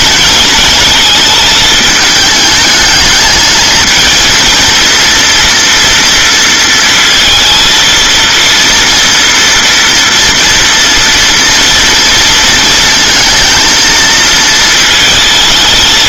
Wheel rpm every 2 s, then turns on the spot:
220, 220, 230, 220, 230, 230, 230, 220.
none